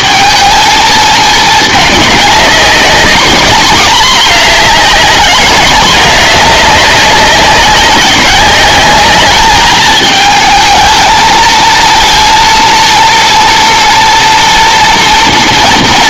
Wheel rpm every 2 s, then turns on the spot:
220, 200, 210, 200, 200, 220, 230, 230.
none